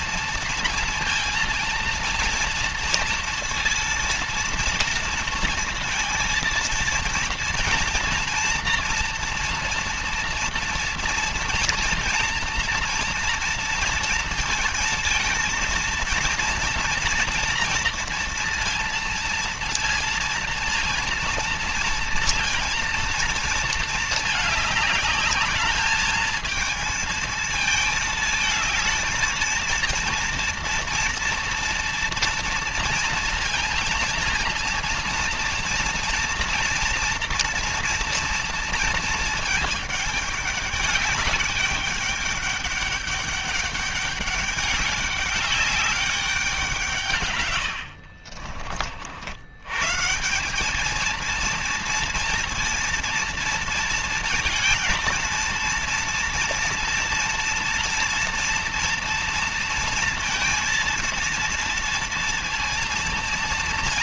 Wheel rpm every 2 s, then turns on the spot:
230, 230, 230, 230, 230, 230, 230, 230, 230, 230, 230, 230, 210, 220, 220, 230, 230, 230, 230, 220, 200, 200, 200, 160, 60, 220, 230, 230, 230, 230, 230, 230.
none